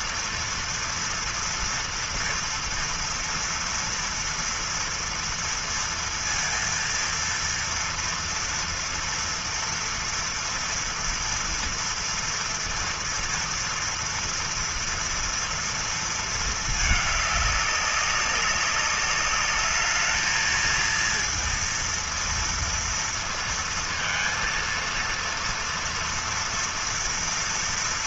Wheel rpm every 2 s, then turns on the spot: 230, 230, 230, 230, 240, 230, 230, 230, 210, 200, 230, 230, 230, 230.
none